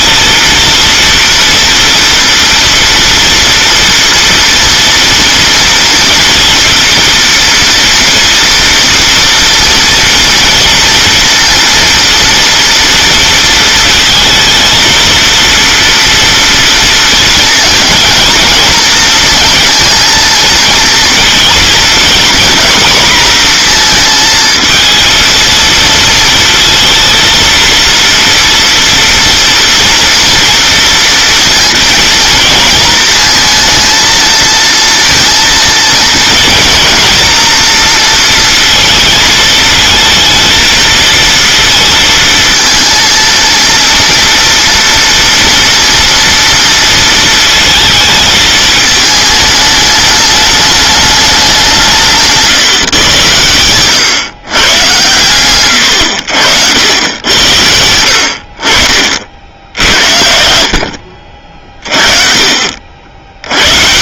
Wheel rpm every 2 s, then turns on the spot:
230, 230, 230, 230, 230, 230, 230, 230, 230, 230, 230, 240, 220, 230, 240, 230, 230, 230, 230, 230, 220, 230, 230, 230, 220, 210, 140, 130, 90, 50, 70, 70.
none